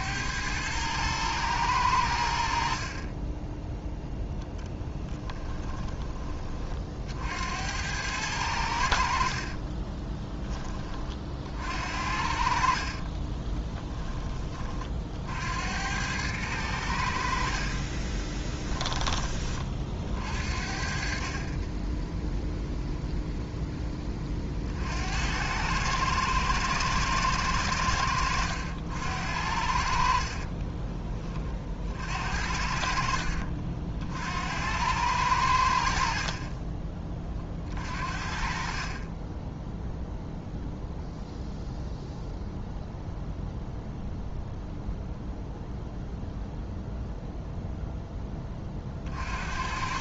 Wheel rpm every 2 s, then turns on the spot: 110, 40, 10, 50, 80, 30, 40, 40, 90, 20, 50, 0, 60, 110, 80, 20, 50, 90, 30, 30, 0, 0, 0, 0, 40.
4-6 12-14 30-32 38-40